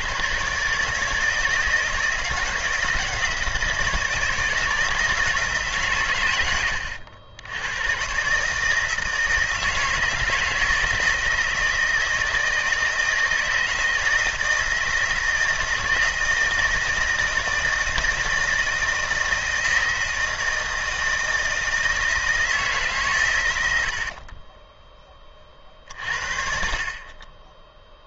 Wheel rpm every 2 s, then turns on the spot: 150, 160, 160, 90, 160, 160, 160, 160, 160, 160, 160, 130, 10, 40.
none